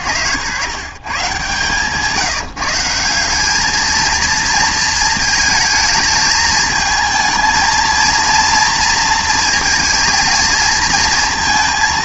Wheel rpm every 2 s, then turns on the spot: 110, 160, 230, 220, 230, 220.
none